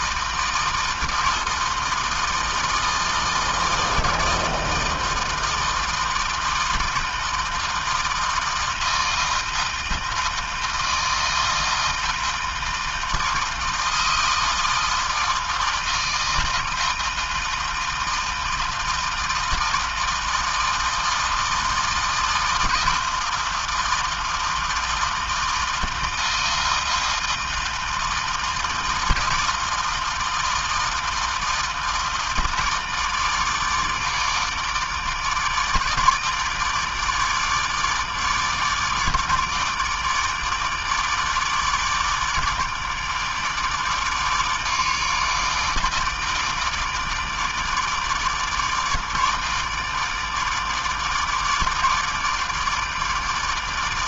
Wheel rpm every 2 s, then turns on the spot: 160, 160, 160, 160, 160, 160, 160, 160, 160, 160, 160, 160, 160, 160, 160, 160, 160, 150, 150, 150, 160, 150, 150, 150, 150, 150, 160.
none